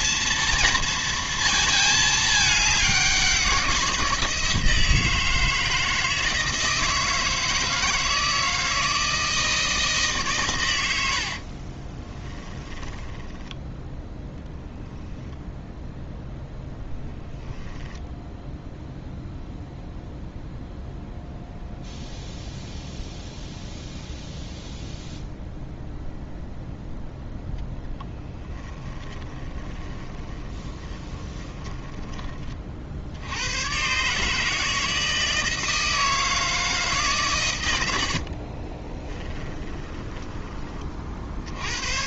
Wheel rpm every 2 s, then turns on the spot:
230, 200, 160, 160, 160, 90, 10, 10, 0, 0, 0, 0, 0, 0, 20, 20, 50, 160, 150, 20, 40.
12-14 28-32 38-40